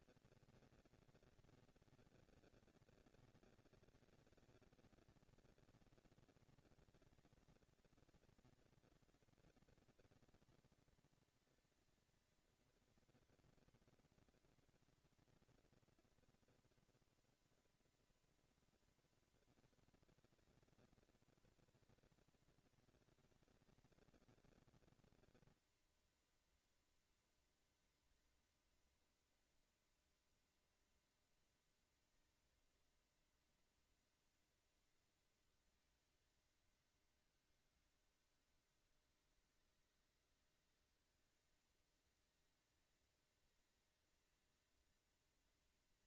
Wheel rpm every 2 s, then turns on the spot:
230, 230, 230, 220, 230, 240, 240, 230, 230, 230, 230, 230, 230, 230, 230, 230, 230, 230, 220, 190, 200, 230, 230.
none